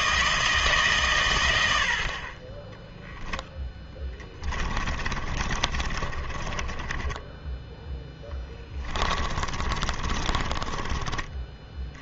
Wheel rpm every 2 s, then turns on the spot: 150, 20, 20, 20, 10, 30.
4-12